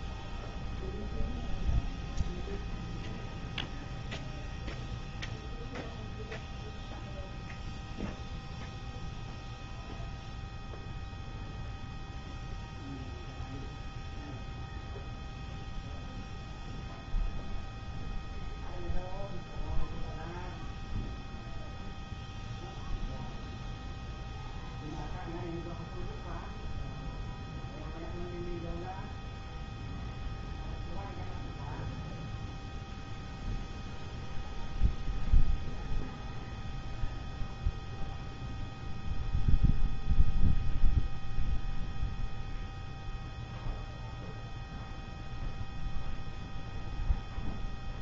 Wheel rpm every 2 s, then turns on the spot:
0, 0, 0, 0, 0, 0, 0, 0, 0, 0, 0, 0, 0, 0, 0, 0, 0, 0, 0, 0, 0, 0, 0, 0.
none